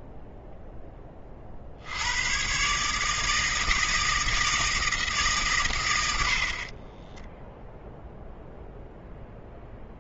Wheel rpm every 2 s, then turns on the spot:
10, 140, 160, 30, 0.
6-8